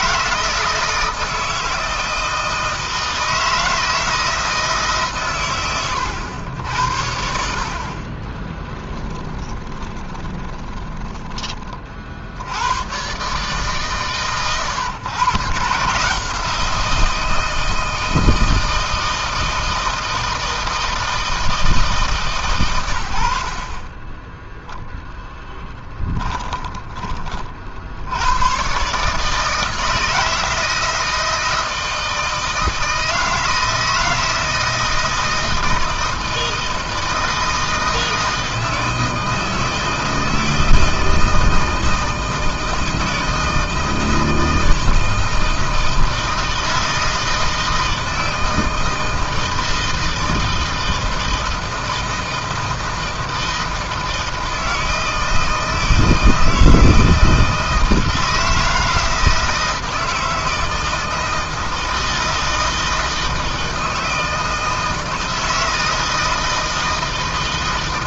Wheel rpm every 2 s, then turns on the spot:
160, 160, 150, 90, 20, 20, 100, 120, 170, 160, 160, 110, 0, 20, 130, 160, 160, 160, 160, 160, 160, 160, 160, 160, 160, 160, 160, 160, 160, 160, 160, 160, 160, 160.
8-12